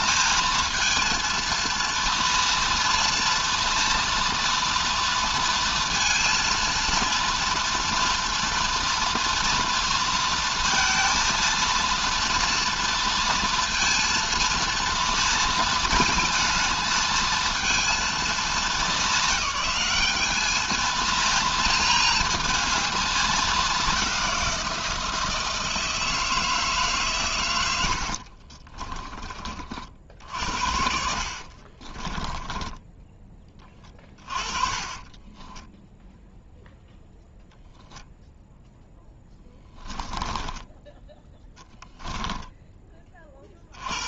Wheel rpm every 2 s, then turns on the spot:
230, 230, 230, 230, 240, 230, 240, 230, 230, 190, 230, 220, 170, 150, 30, 60, 10, 20, 0, 0, 10, 20.
28-30 32-36